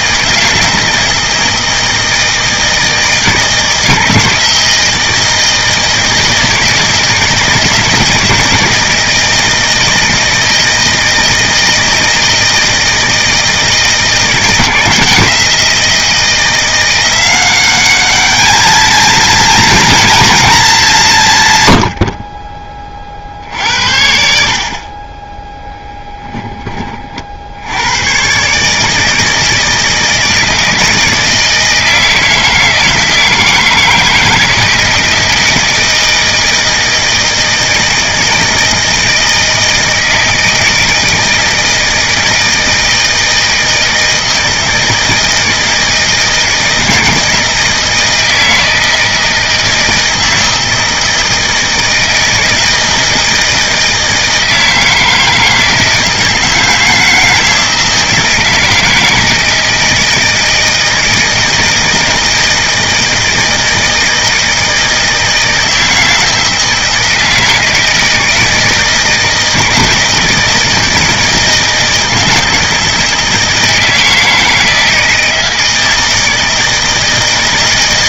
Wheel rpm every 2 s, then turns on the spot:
160, 160, 160, 160, 160, 160, 160, 170, 170, 220, 190, 20, 40, 30, 150, 160, 160, 160, 160, 160, 160, 160, 160, 160, 160, 160, 160, 160, 160, 160, 160, 160, 160, 160, 160, 160, 160, 160, 160.
none